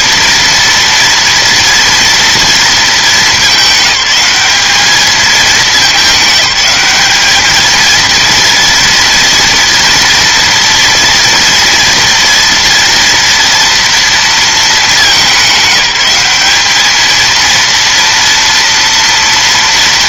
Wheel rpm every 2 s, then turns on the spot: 230, 230, 210, 210, 230, 230, 230, 220, 210, 230.
none